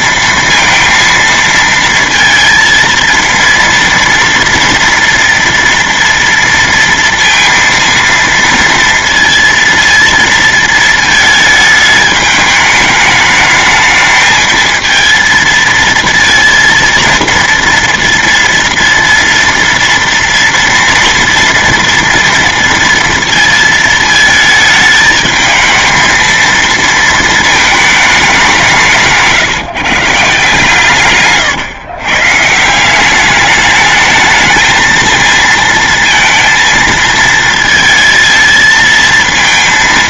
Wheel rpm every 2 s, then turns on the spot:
230, 230, 230, 230, 230, 230, 210, 220, 230, 230, 230, 230, 220, 230, 170, 140, 160, 220, 230, 220.
none